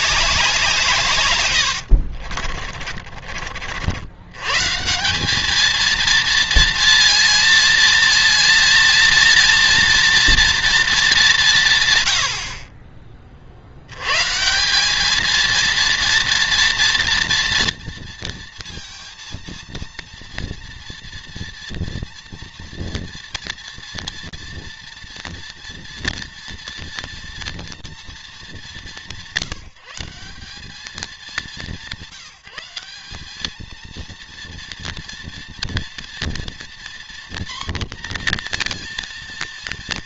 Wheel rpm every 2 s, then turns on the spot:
180, 40, 130, 230, 230, 230, 70, 180, 230, 230, 230, 230, 230, 230, 220, 190, 160, 230, 240, 240.
2-4